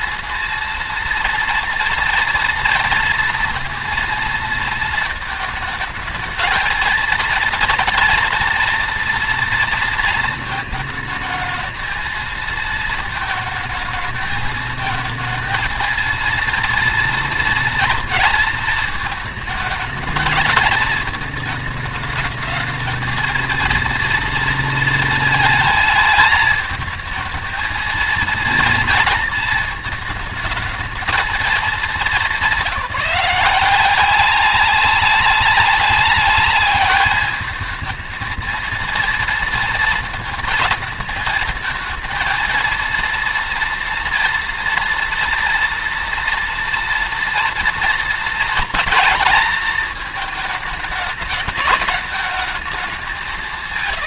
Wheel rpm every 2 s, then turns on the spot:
230, 230, 220, 220, 230, 220, 220, 220, 230, 230, 220, 220, 230, 220, 220, 220, 200, 190, 210, 230, 230, 230, 230, 230, 230, 220, 210.
none